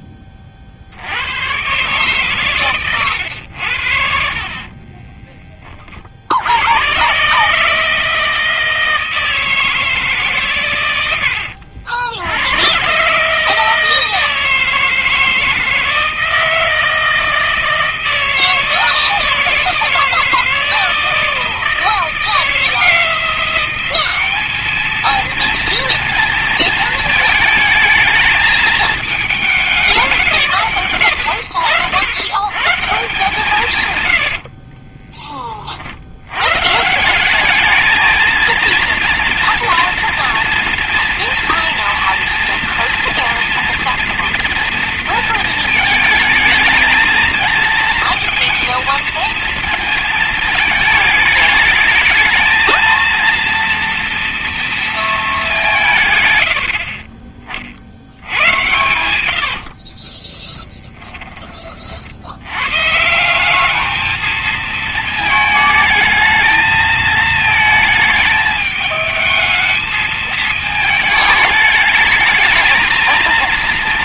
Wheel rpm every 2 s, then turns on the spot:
30, 110, 40, 80, 160, 120, 100, 160, 160, 160, 160, 170, 210, 230, 220, 190, 140, 80, 110, 220, 240, 230, 230, 220, 230, 230, 220, 230, 100, 90, 20, 90, 220, 220, 220, 220, 220.
2-6 34-36 56-62